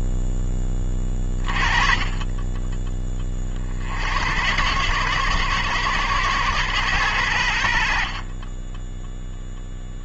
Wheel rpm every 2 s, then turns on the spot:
20, 10, 110, 110, 10.
none